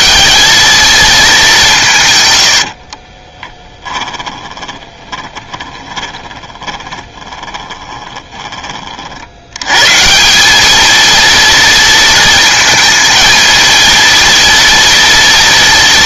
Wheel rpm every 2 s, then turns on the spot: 220, 60, 20, 30, 40, 220, 230, 230.
2-8